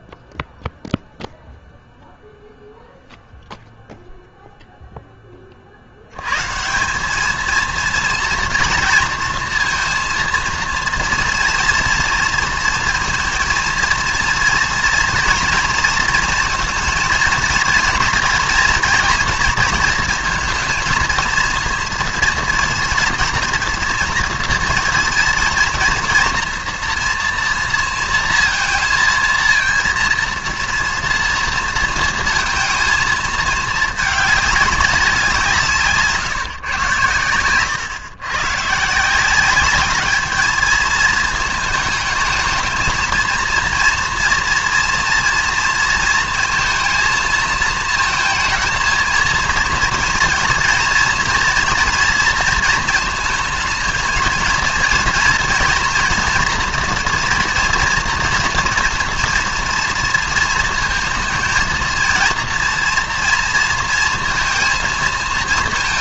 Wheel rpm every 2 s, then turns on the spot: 0, 0, 0, 170, 230, 230, 230, 230, 230, 240, 230, 230, 230, 230, 230, 230, 220, 210, 120, 130, 220, 220, 240, 230, 220, 230, 230, 230, 230, 230, 220, 230, 230.
none